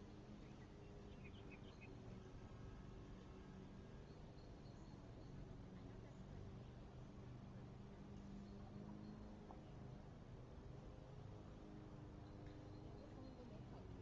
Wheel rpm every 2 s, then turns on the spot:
0, 0, 0, 0, 0, 0, 0.
none